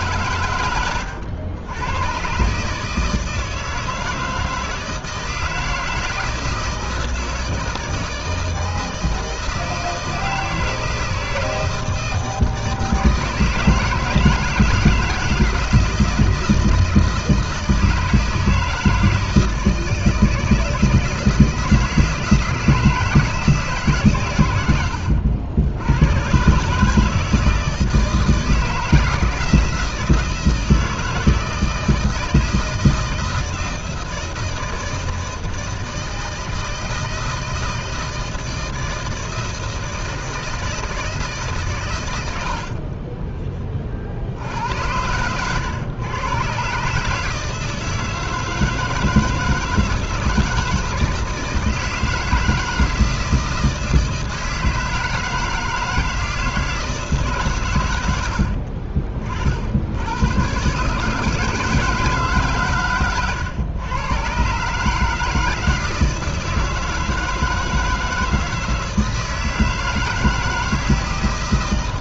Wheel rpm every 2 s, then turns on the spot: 120, 140, 160, 160, 160, 160, 160, 170, 160, 160, 160, 160, 100, 140, 160, 160, 160, 160, 160, 160, 160, 70, 80, 130, 160, 160, 160, 160, 160, 60, 120, 140, 140, 160, 160, 160.
42-44 58-60